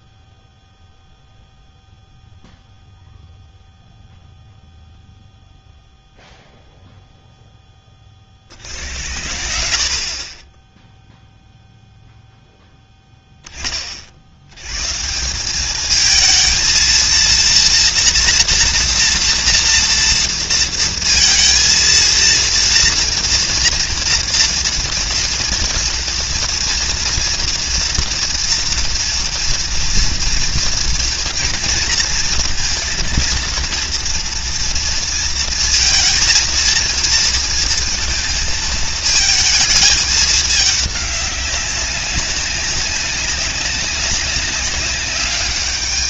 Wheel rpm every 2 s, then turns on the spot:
0, 0, 0, 0, 20, 70, 0, 30, 210, 240, 230, 230, 230, 230, 230, 230, 230, 230, 230, 230, 220, 200, 200.
none